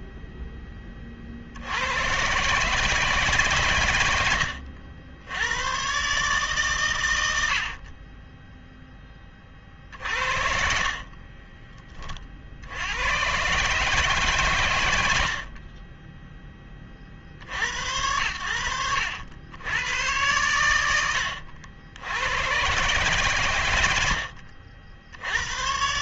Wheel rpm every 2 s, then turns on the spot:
20, 150, 70, 130, 0, 60, 90, 110, 20, 90, 100, 130, 70.
none